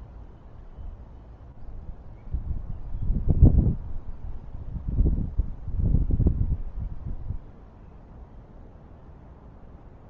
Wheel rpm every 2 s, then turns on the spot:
0, 0, 0, 0, 0.
none